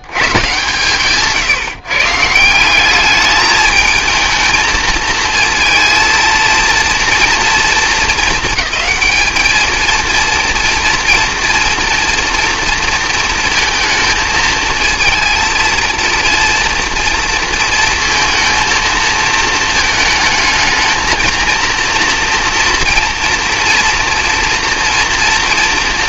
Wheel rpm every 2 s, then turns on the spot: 130, 180, 220, 230, 210, 230, 230, 220, 230, 230, 220, 230, 230.
none